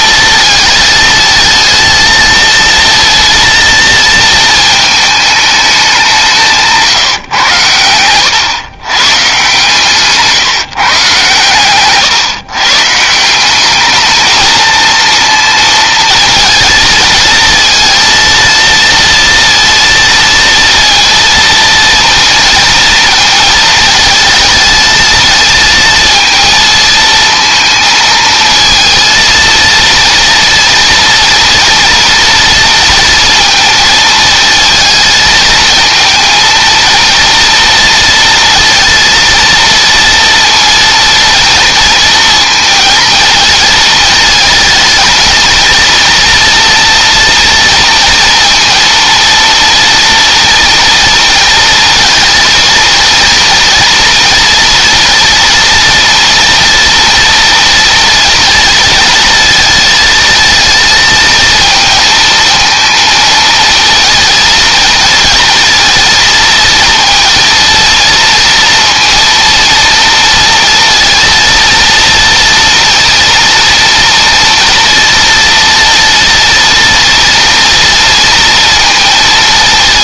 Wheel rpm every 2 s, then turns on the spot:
220, 230, 220, 160, 130, 140, 150, 230, 230, 230, 230, 230, 220, 230, 230, 230, 230, 220, 230, 230, 230, 230, 220, 230, 230, 230, 230, 230, 230, 230, 220, 230, 230, 230, 230, 230, 230, 230, 230, 230.
none